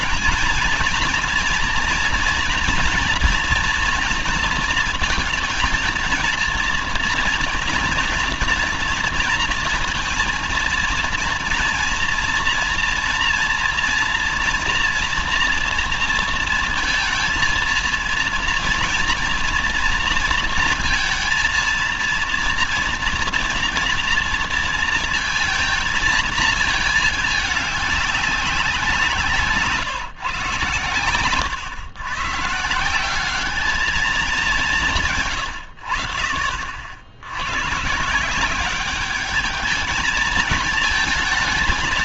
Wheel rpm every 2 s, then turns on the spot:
220, 230, 230, 230, 240, 230, 230, 230, 230, 230, 230, 230, 230, 220, 180, 120, 160, 190, 50, 190, 220.
none